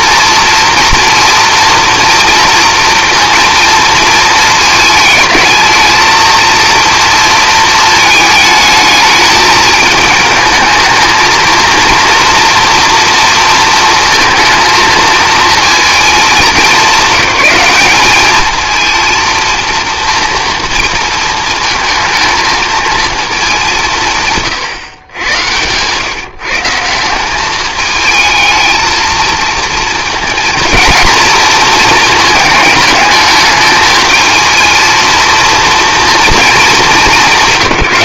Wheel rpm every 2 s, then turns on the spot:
230, 230, 220, 230, 210, 220, 230, 220, 190, 220, 230, 220, 130, 170, 220, 230, 220, 220, 220.
none